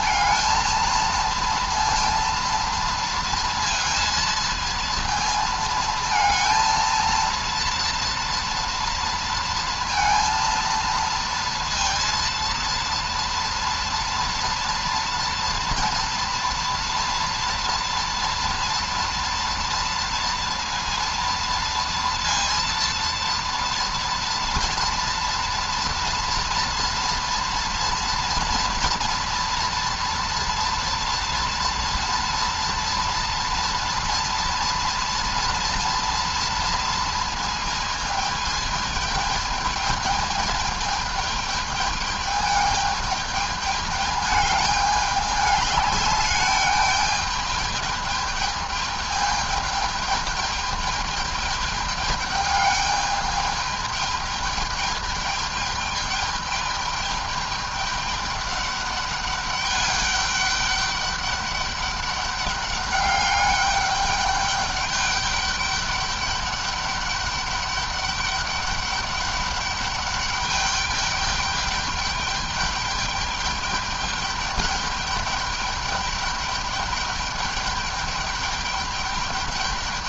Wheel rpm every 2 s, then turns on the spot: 230, 230, 230, 220, 230, 230, 230, 240, 230, 230, 230, 230, 230, 230, 230, 230, 230, 240, 230, 220, 220, 210, 210, 200, 210, 210, 210, 220, 210, 210, 200, 200, 200, 200, 200, 200, 210, 200, 210, 210.
none